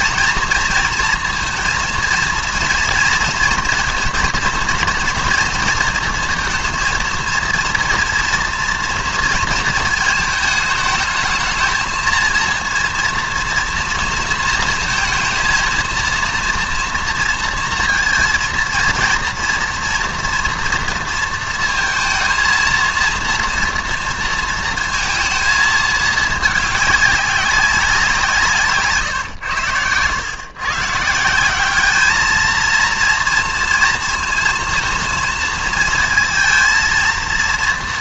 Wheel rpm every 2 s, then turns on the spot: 230, 230, 230, 230, 230, 220, 230, 230, 230, 230, 230, 220, 230, 210, 170, 120, 220, 230, 230.
none